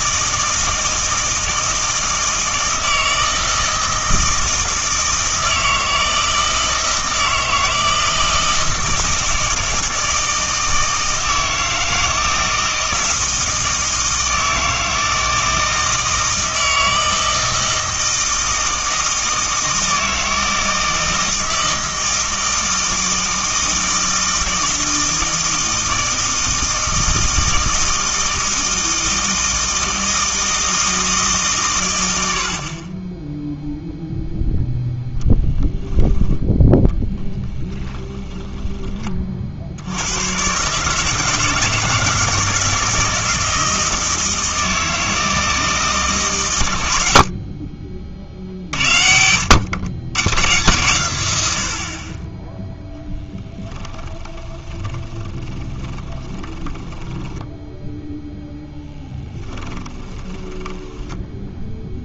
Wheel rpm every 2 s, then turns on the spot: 160, 160, 160, 160, 160, 160, 160, 160, 160, 160, 160, 160, 160, 160, 160, 160, 50, 0, 0, 20, 140, 170, 160, 90, 60, 130, 10, 20, 10, 10, 10.
54-62